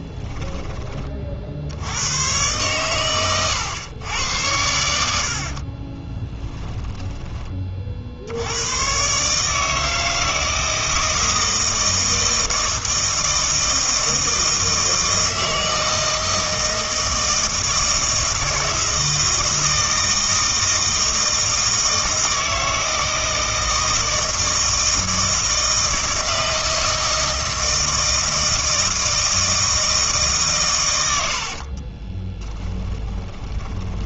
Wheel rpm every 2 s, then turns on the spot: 20, 120, 90, 10, 90, 160, 160, 160, 160, 160, 160, 160, 160, 160, 160, 130, 20.
6-8 32-34